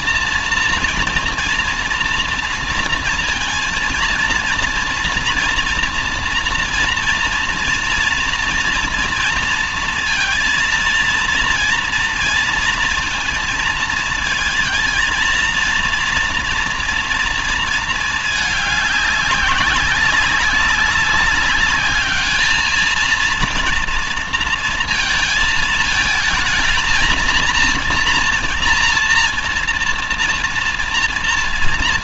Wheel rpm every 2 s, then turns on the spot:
240, 230, 230, 240, 230, 230, 230, 230, 230, 200, 190, 220, 230, 220, 230, 230.
none